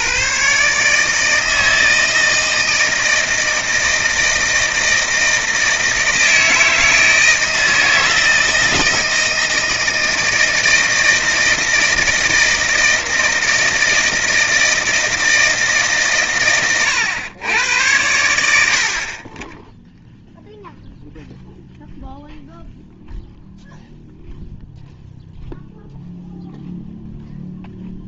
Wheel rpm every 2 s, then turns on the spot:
140, 160, 160, 160, 160, 160, 160, 160, 120, 80, 0, 0, 0, 0.
none